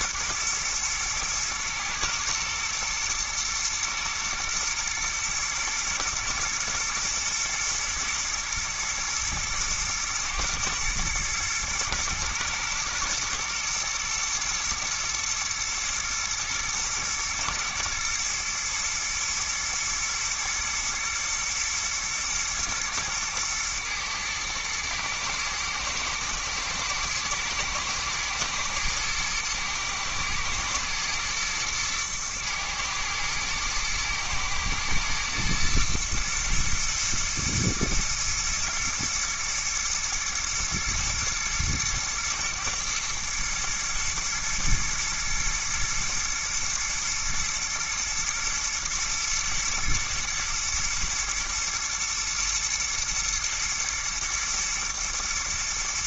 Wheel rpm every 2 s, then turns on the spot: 120, 120, 110, 110, 110, 120, 110, 110, 110, 110, 110, 110, 110, 110, 120, 110, 110, 120, 110, 120, 110, 110, 110, 120, 120, 120, 120, 120.
none